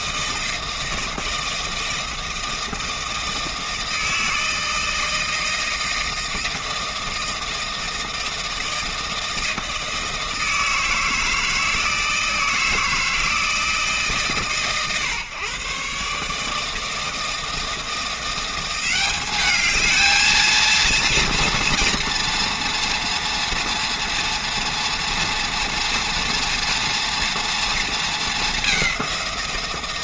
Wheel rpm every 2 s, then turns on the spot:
160, 160, 160, 160, 160, 160, 160, 120, 160, 180, 230, 240, 240, 230, 190.
none